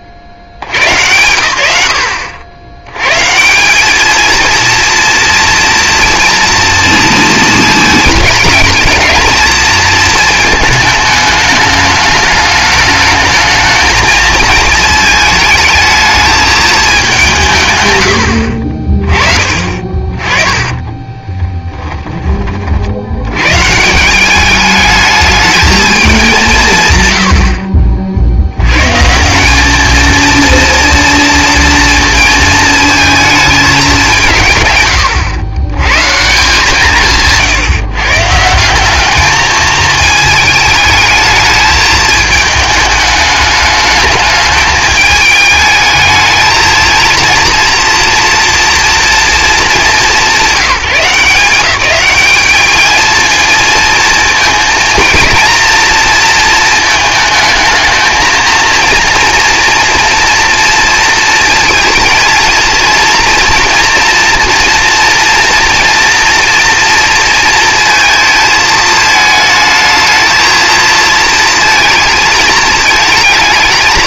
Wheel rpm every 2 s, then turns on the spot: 50, 90, 230, 230, 220, 220, 210, 220, 210, 40, 10, 50, 210, 130, 150, 230, 220, 130, 160, 190, 210, 210, 210, 230, 230, 180, 220, 230, 230, 230, 230, 230, 230, 230, 220, 230, 230.
20-22